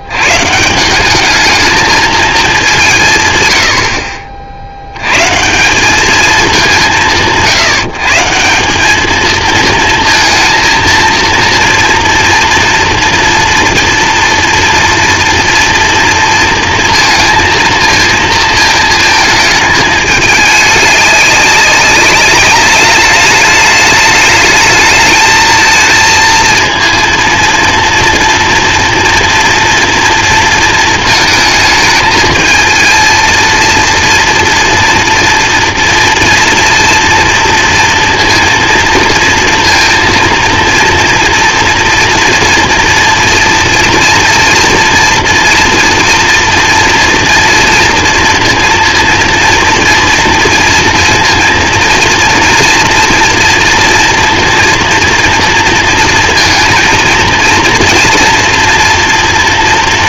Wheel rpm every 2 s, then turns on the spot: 170, 190, 80, 190, 190, 230, 230, 230, 230, 220, 210, 200, 210, 230, 230, 230, 230, 230, 240, 230, 230, 230, 230, 230, 230, 230, 230, 230, 230, 240.
none